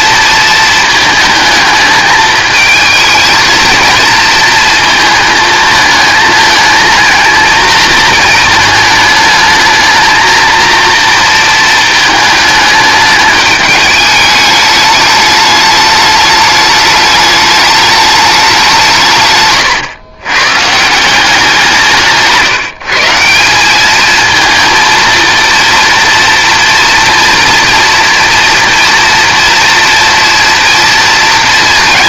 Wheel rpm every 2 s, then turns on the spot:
220, 220, 220, 220, 220, 230, 210, 210, 210, 160, 170, 150, 230, 240, 240, 230.
none